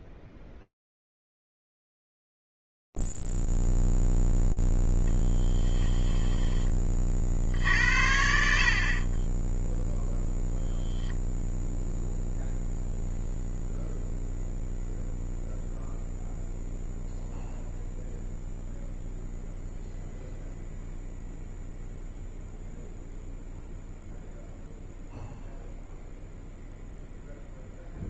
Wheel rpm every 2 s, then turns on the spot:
0, 0, 0, 10, 60, 0, 0, 0, 0, 0, 0, 0, 0, 0.
none